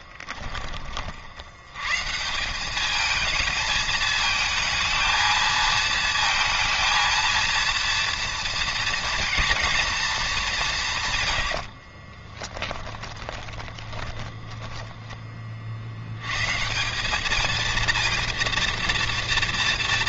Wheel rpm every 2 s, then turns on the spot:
20, 190, 220, 230, 230, 190, 20, 20, 150, 230.
12-16